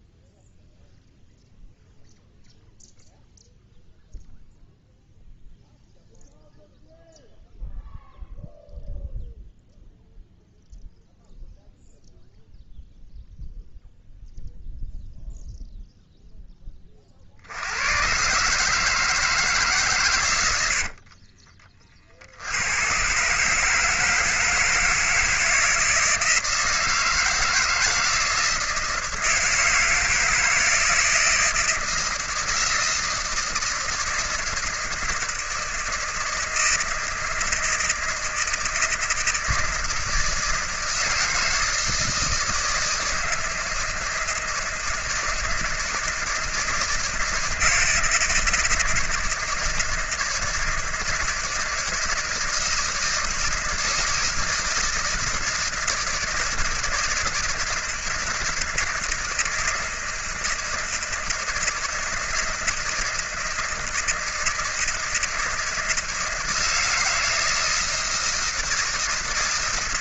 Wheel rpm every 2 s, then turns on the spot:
0, 0, 0, 0, 0, 0, 0, 0, 30, 150, 80, 100, 160, 160, 160, 160, 160, 160, 160, 160, 160, 160, 160, 160, 160, 160, 160, 160, 160, 160, 160, 160, 160, 160, 160.
20-22